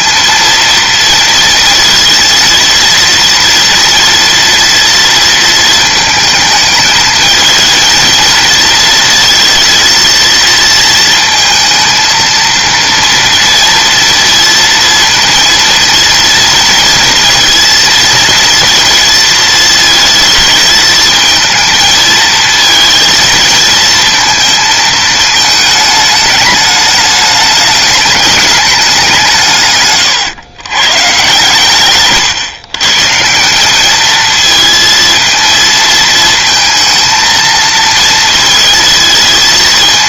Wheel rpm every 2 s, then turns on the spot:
230, 230, 230, 220, 230, 230, 230, 230, 230, 230, 230, 230, 220, 210, 200, 120, 130, 230, 220, 220.
none